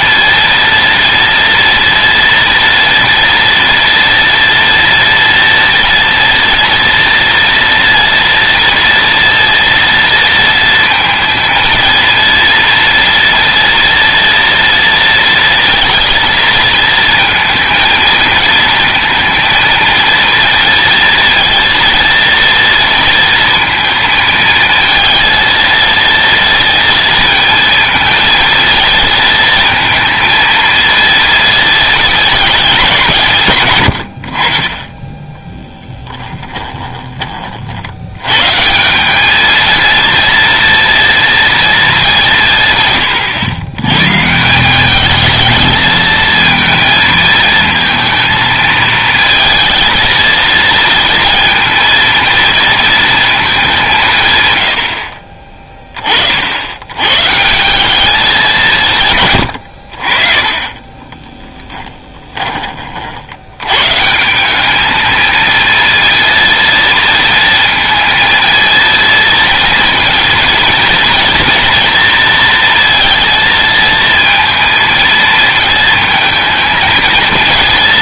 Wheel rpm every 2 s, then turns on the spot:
230, 230, 230, 230, 230, 230, 230, 230, 220, 230, 230, 230, 220, 230, 230, 230, 190, 20, 20, 170, 230, 140, 190, 220, 220, 230, 230, 90, 90, 170, 20, 30, 210, 230, 230, 230, 230, 230, 220.
36-38 60-62